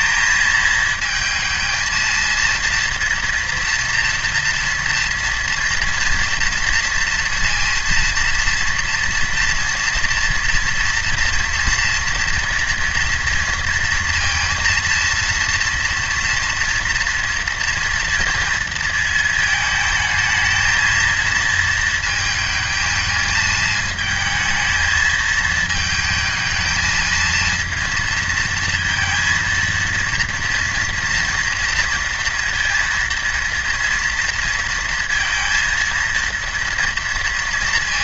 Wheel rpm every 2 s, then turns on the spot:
220, 230, 230, 230, 230, 230, 230, 230, 240, 230, 220, 220, 220, 220, 230, 230, 230, 230, 230.
none